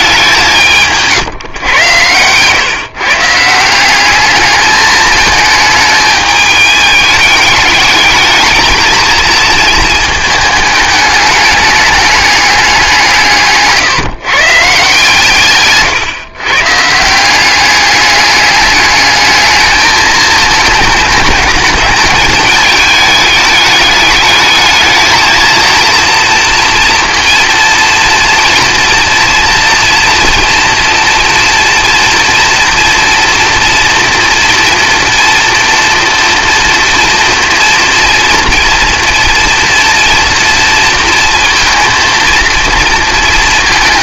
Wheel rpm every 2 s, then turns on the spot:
190, 120, 210, 210, 220, 220, 210, 140, 130, 200, 220, 220, 210, 230, 230, 230, 240, 230, 230, 230, 240, 230.
2-4